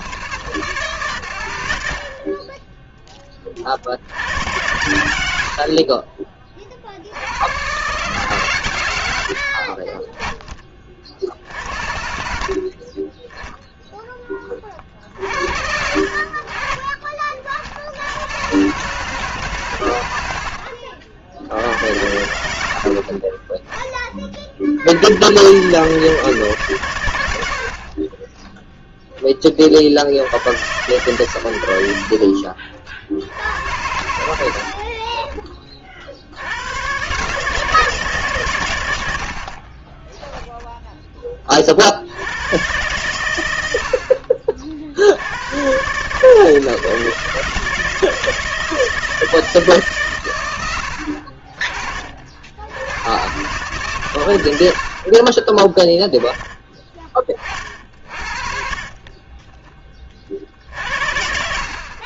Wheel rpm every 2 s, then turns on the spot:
130, 10, 100, 90, 70, 50, 20, 40, 40, 140, 60, 60, 80, 110, 10, 110, 60, 40, 120, 90, 10, 120, 60, 160, 160, 60, 100, 50, 20, 40, 50.
54-56 58-60